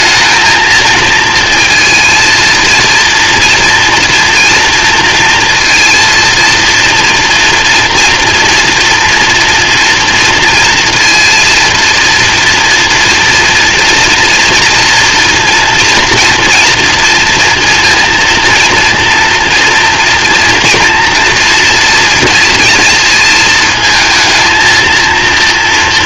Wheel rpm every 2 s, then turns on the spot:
220, 230, 230, 230, 230, 230, 230, 230, 230, 230, 230, 230, 220.
none